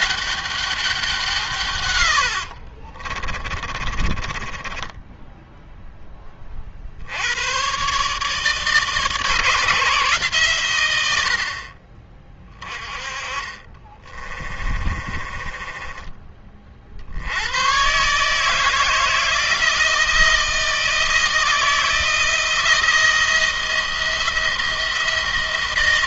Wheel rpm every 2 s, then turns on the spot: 200, 60, 20, 40, 150, 120, 30, 30, 40, 160, 160, 170, 170.
2-6 14-16